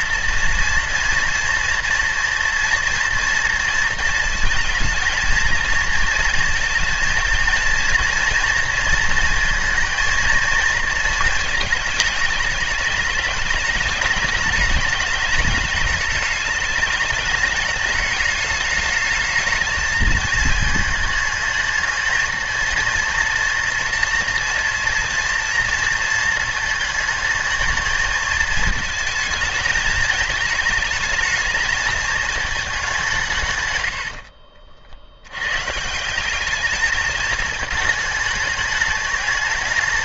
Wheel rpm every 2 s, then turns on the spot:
240, 230, 230, 230, 230, 230, 210, 210, 210, 220, 220, 230, 230, 220, 220, 220, 210, 70, 210, 210.
none